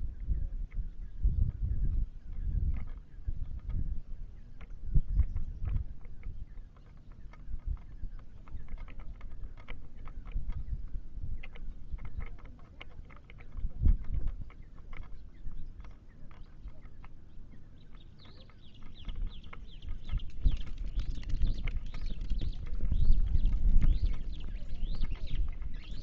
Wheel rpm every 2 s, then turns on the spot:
0, 0, 0, 0, 0, 0, 0, 0, 0, 0, 0, 0, 0.
none